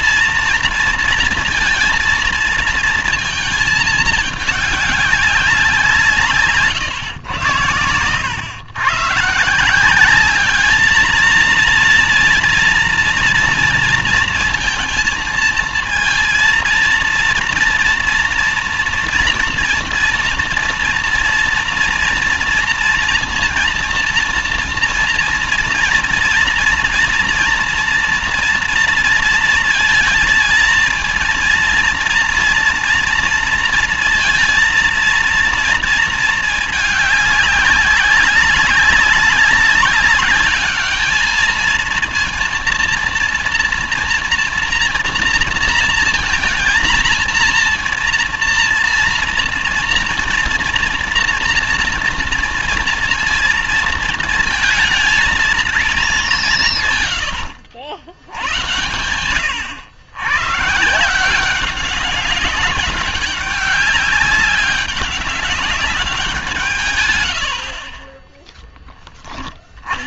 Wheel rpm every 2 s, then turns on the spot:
230, 230, 200, 120, 120, 210, 230, 230, 230, 230, 230, 230, 230, 230, 230, 230, 230, 230, 210, 200, 210, 230, 230, 230, 230, 240, 230, 230, 140, 100, 140, 200, 200, 150, 0.
none